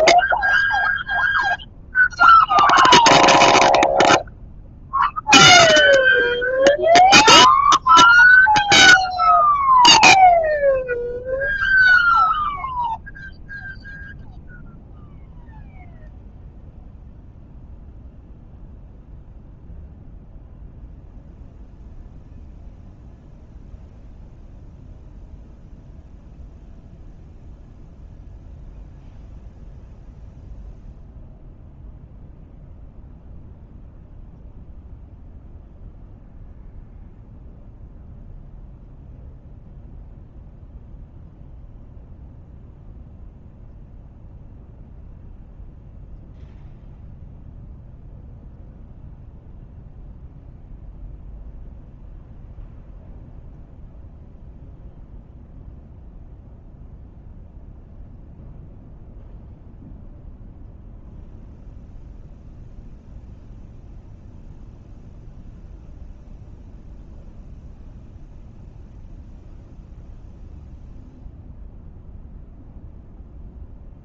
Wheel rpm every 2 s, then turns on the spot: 0, 0, 0, 0, 0, 0, 0, 0, 0, 0, 0, 0, 0, 0, 0, 0, 0, 0, 0, 0, 0, 0, 0, 0, 0, 0, 0, 0, 0, 0, 0, 0, 0, 0, 0, 0, 0.
none